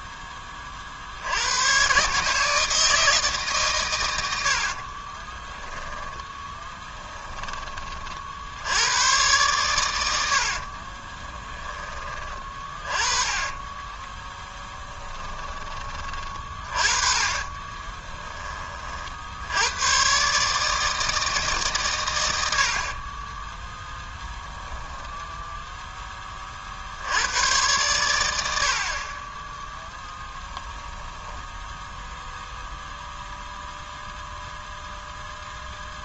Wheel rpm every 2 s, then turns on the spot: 40, 160, 50, 10, 90, 50, 30, 10, 40, 40, 150, 60, 10, 50, 60, 10, 0, 0.
4-8 10-18 24-26 30-32